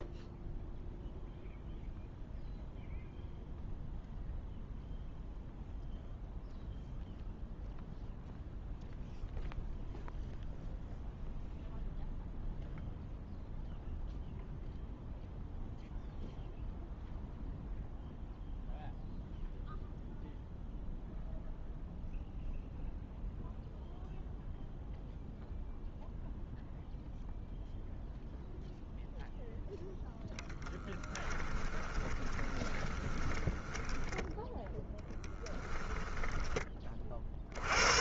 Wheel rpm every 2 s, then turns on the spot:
0, 0, 0, 0, 0, 0, 0, 0, 0, 0, 0, 0, 0, 0, 0, 0, 20, 10, 10.
32-36